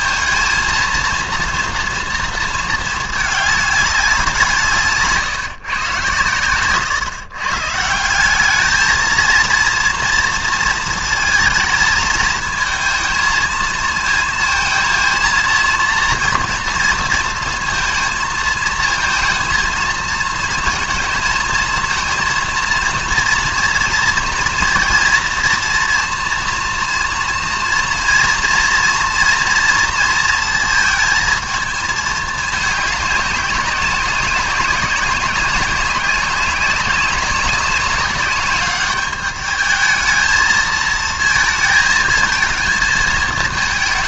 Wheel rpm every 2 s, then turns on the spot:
230, 230, 170, 120, 200, 230, 220, 230, 230, 220, 220, 230, 230, 230, 230, 230, 210, 190, 190, 200, 220, 220.
none